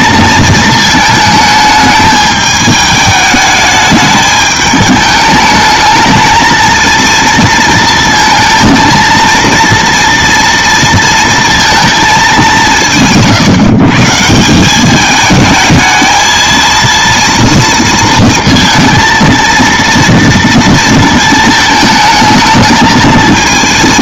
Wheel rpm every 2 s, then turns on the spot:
220, 210, 210, 230, 220, 230, 170, 200, 230, 230, 230, 220.
none